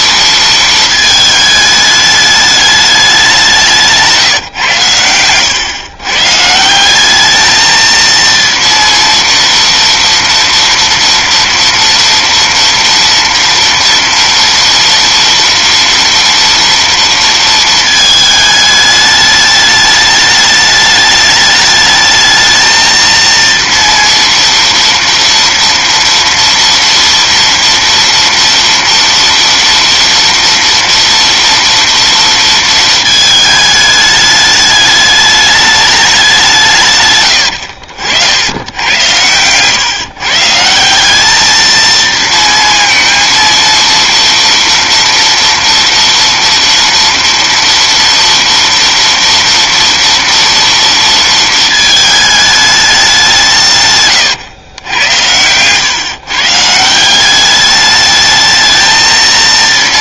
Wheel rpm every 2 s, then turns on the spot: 230, 210, 130, 170, 230, 230, 230, 230, 230, 210, 210, 220, 230, 230, 230, 230, 230, 210, 160, 100, 160, 230, 230, 230, 240, 230, 210, 100, 160, 220.
none